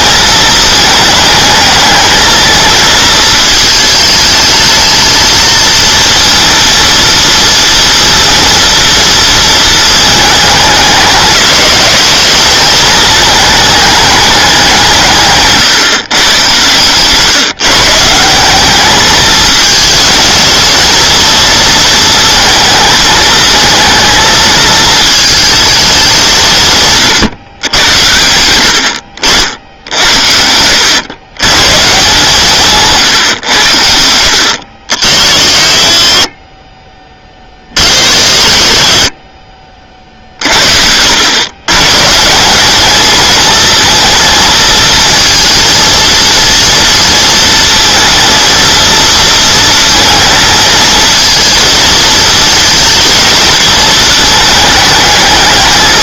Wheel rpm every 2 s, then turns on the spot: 220, 220, 220, 230, 230, 210, 210, 180, 120, 200, 230, 230, 230, 150, 80, 90, 160, 70, 20, 50, 70, 200, 230, 230, 220, 220, 220, 210.
16-18